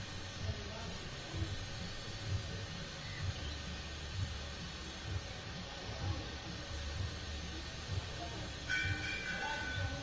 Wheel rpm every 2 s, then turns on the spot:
0, 0, 0, 0, 0.
none